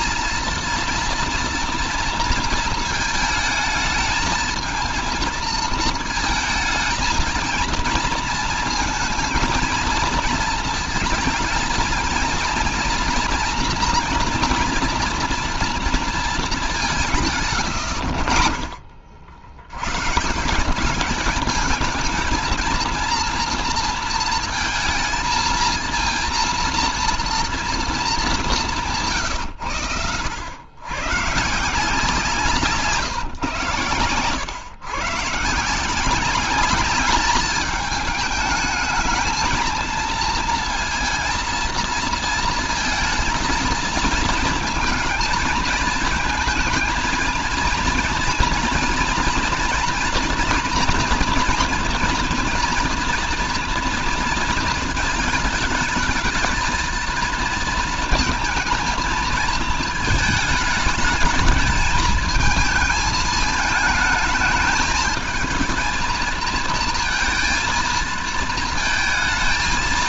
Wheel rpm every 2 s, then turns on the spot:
230, 220, 220, 220, 230, 220, 230, 230, 180, 50, 180, 230, 220, 230, 170, 110, 150, 120, 200, 210, 230, 220, 230, 230, 230, 230, 230, 220, 230, 230, 220, 220, 220, 230, 230.
none